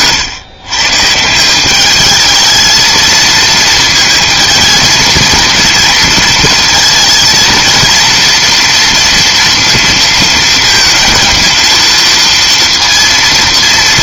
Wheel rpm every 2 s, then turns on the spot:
120, 220, 230, 230, 230, 230, 230.
none